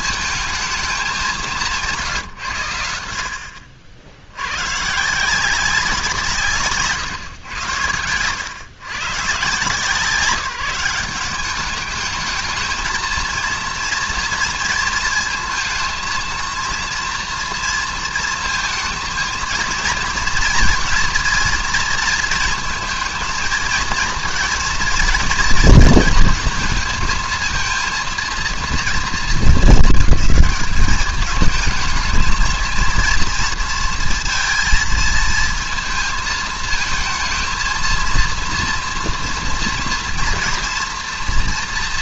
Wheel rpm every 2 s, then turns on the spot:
220, 90, 120, 140, 100, 170, 220, 230, 230, 220, 230, 230, 240, 230, 230, 210, 230, 230, 220, 230, 230.
none